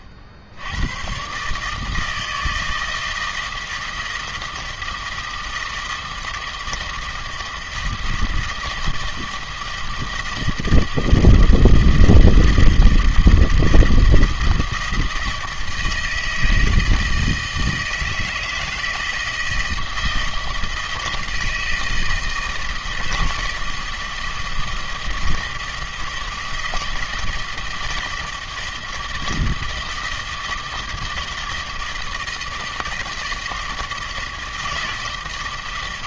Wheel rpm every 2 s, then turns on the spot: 70, 160, 160, 160, 160, 160, 160, 160, 160, 160, 160, 160, 160, 160, 160, 160, 160, 160.
none